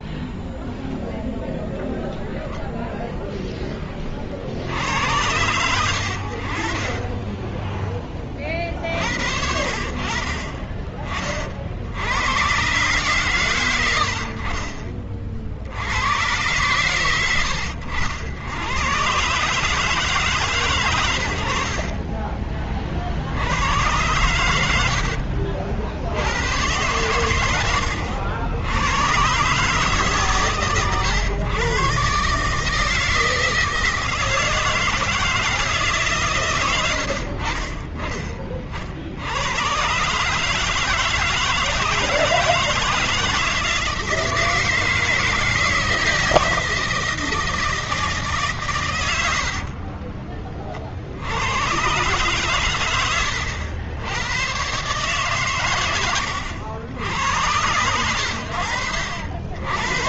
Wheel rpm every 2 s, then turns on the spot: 0, 0, 70, 50, 50, 40, 120, 50, 100, 100, 130, 40, 80, 90, 80, 140, 150, 160, 110, 50, 150, 160, 160, 160, 130, 40, 120, 120, 100, 80.
24-26